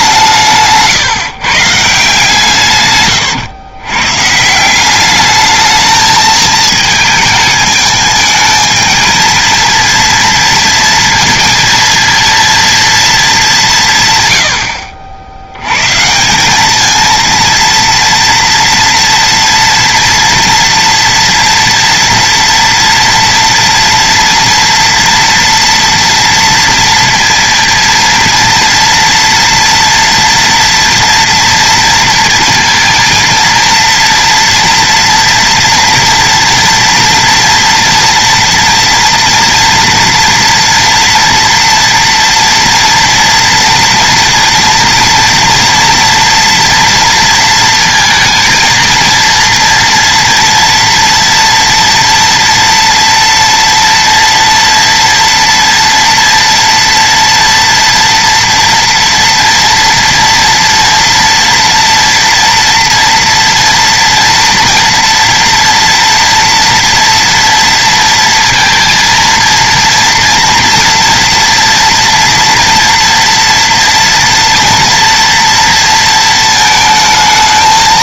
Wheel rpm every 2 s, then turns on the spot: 150, 130, 170, 220, 220, 230, 230, 40, 210, 230, 230, 240, 240, 230, 230, 230, 230, 240, 230, 230, 230, 230, 230, 230, 230, 230, 230, 230, 230, 230, 230, 230, 230, 240, 230, 240, 230, 230, 220.
none